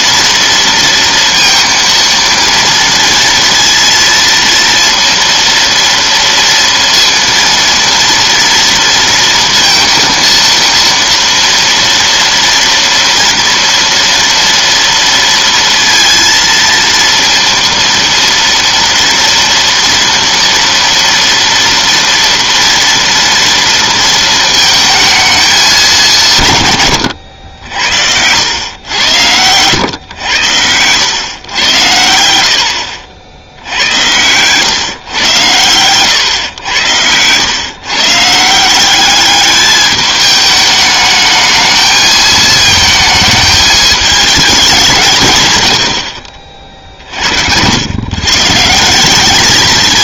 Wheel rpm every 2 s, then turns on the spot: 230, 230, 230, 230, 230, 230, 230, 230, 230, 230, 230, 230, 220, 130, 90, 100, 80, 120, 110, 170, 210, 220, 190, 50, 160.
none